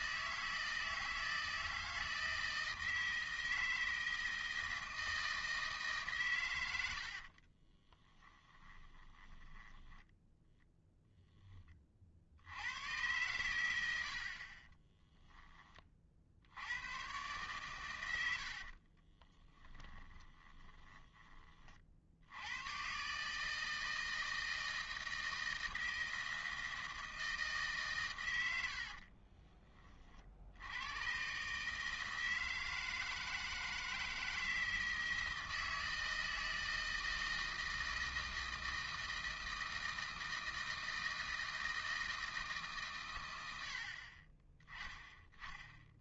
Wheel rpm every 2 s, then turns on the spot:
160, 160, 160, 100, 10, 0, 90, 20, 100, 50, 20, 110, 160, 160, 80, 90, 160, 160, 160, 160, 160, 150, 20.
8-10 14-16 18-22 28-30